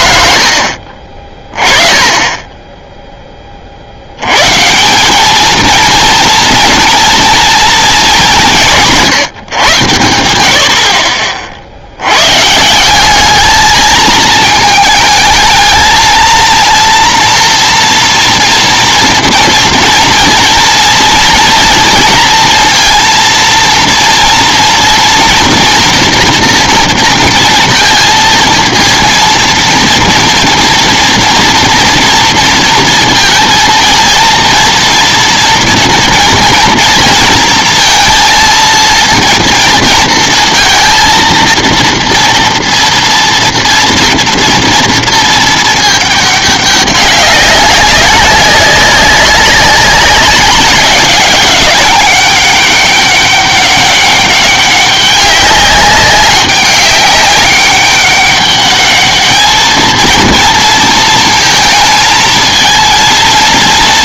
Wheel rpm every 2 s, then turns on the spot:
20, 40, 220, 230, 140, 50, 210, 220, 230, 230, 240, 230, 240, 230, 230, 230, 230, 230, 230, 230, 230, 240, 220, 200, 190, 190, 200, 200, 200, 220, 220, 230.
none